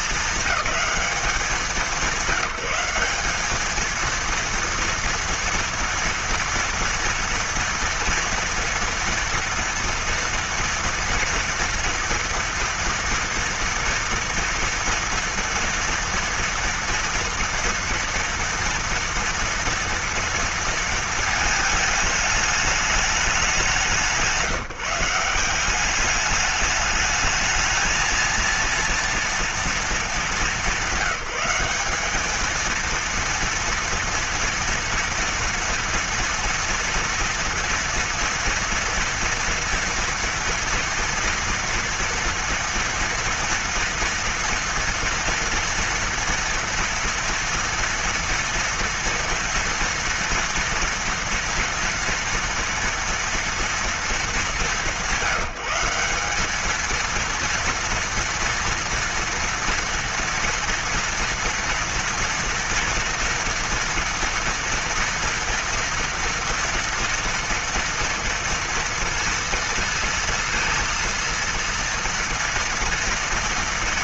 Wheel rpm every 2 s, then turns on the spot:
220, 190, 230, 230, 230, 230, 230, 230, 230, 230, 230, 220, 180, 210, 230, 210, 220, 240, 230, 230, 230, 230, 230, 230, 230, 230, 230, 200, 200, 230, 230, 230, 230, 230, 230, 230, 230.
none